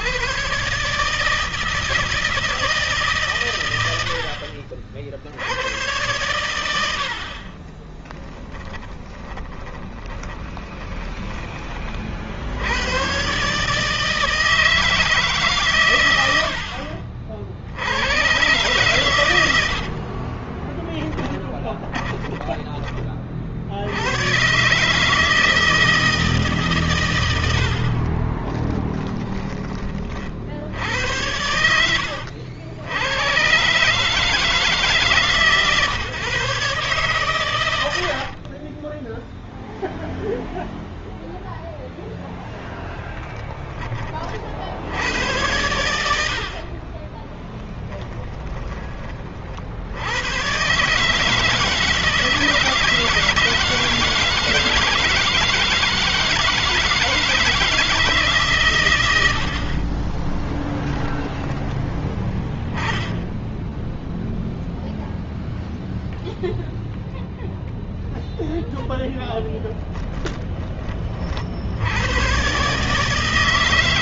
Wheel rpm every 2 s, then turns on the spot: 150, 150, 50, 80, 10, 10, 100, 160, 60, 120, 20, 30, 140, 130, 20, 90, 90, 150, 130, 20, 0, 10, 80, 30, 40, 140, 160, 160, 160, 100, 10, 10, 0, 0, 0, 40, 150.
8-12 20-22 28-30 38-40 46-48 60-62